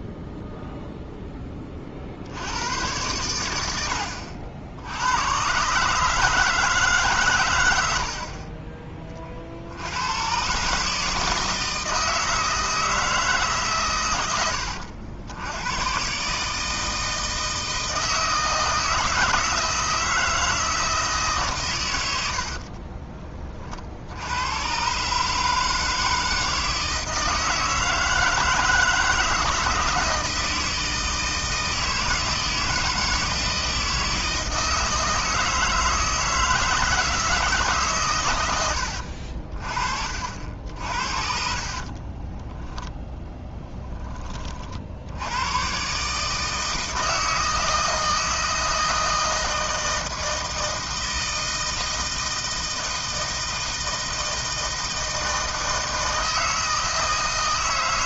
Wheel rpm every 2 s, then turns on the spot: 0, 100, 70, 150, 40, 140, 160, 90, 150, 160, 160, 40, 120, 160, 160, 160, 160, 160, 160, 90, 60, 10, 50, 160, 160, 160, 160, 160, 160.
22-24 42-44